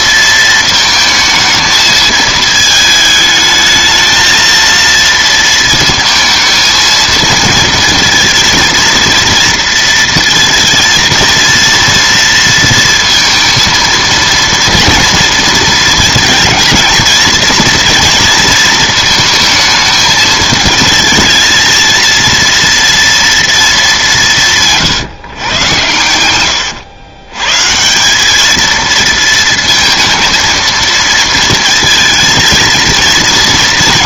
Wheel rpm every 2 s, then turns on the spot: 220, 220, 230, 230, 230, 230, 230, 230, 230, 230, 220, 230, 160, 100, 220, 230, 220.
none